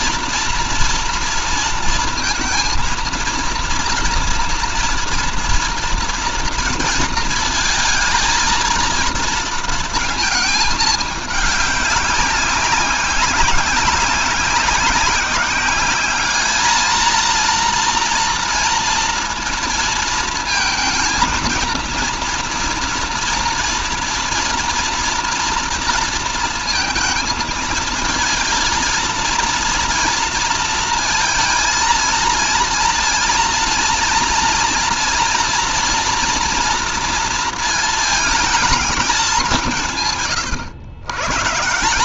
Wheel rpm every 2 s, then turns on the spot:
240, 230, 230, 230, 220, 220, 190, 190, 220, 230, 230, 230, 230, 230, 230, 230, 230, 230, 230, 220, 120.
none